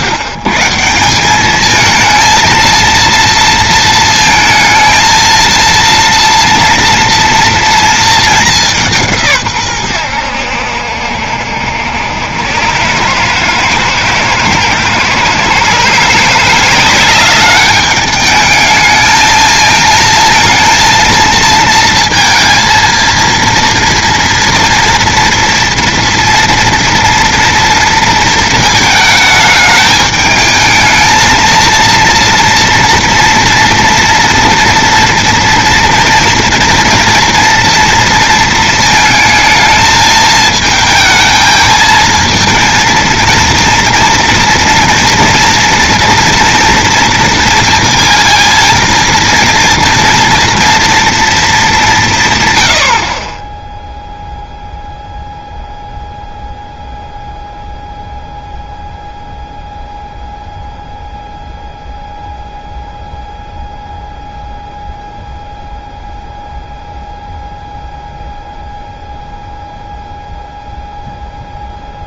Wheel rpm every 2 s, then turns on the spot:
120, 230, 220, 230, 190, 80, 90, 120, 180, 220, 230, 230, 230, 230, 220, 220, 230, 230, 230, 220, 220, 230, 230, 230, 230, 230, 130, 0, 0, 0, 0, 0, 0, 0, 0, 0.
none